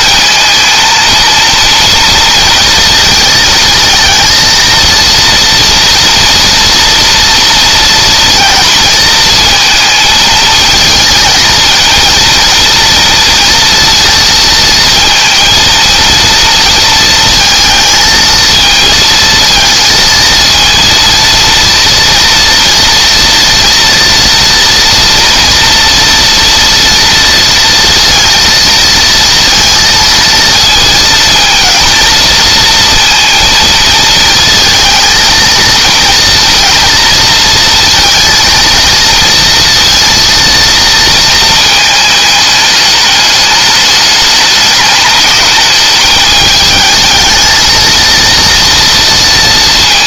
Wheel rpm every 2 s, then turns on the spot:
230, 220, 230, 230, 230, 230, 230, 230, 230, 230, 230, 230, 230, 230, 230, 230, 230, 220, 230, 230, 230, 210, 210, 220, 230.
none